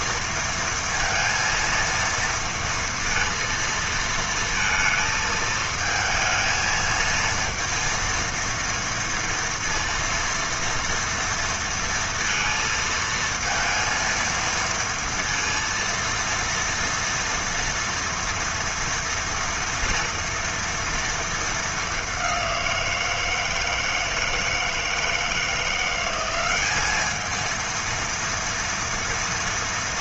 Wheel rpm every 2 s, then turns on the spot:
230, 230, 230, 220, 230, 230, 230, 230, 230, 230, 230, 180, 160, 190, 230.
none